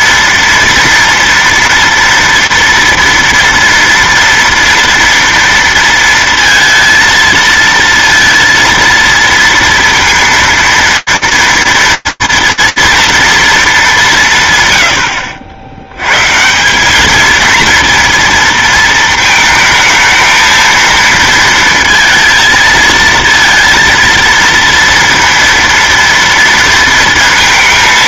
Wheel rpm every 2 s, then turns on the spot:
230, 230, 230, 230, 230, 230, 240, 100, 200, 230, 230, 220, 230, 230.
none